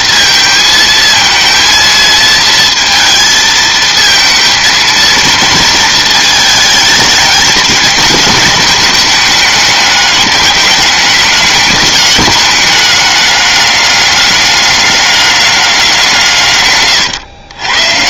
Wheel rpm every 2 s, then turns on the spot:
220, 230, 220, 210, 210, 200, 210, 200, 130.
none